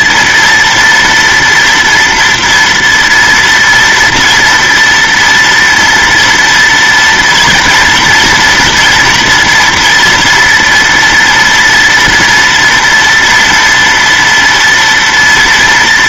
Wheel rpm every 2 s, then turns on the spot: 240, 230, 230, 230, 230, 230, 230, 230.
none